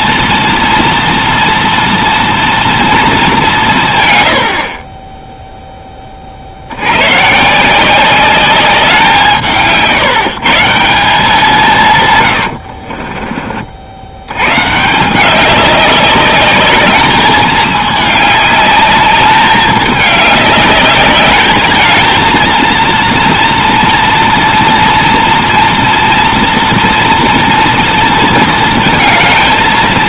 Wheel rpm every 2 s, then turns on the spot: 230, 230, 40, 80, 190, 170, 70, 160, 210, 210, 200, 230, 230, 230, 230.
12-14